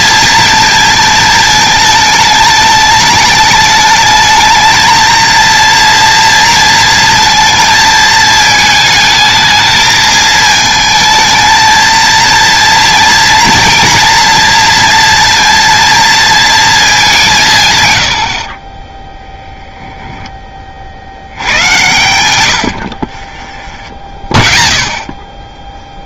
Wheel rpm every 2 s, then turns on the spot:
220, 220, 220, 230, 220, 220, 230, 230, 210, 20, 70, 60, 0.
18-20 22-24